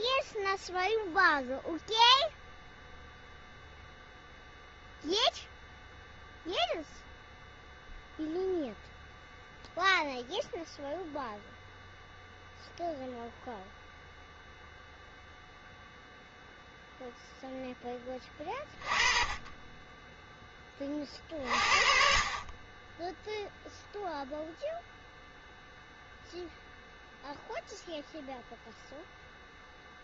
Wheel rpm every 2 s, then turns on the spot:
0, 0, 0, 0, 0, 0, 0, 0, 0, 20, 30, 10, 0, 0, 0.
none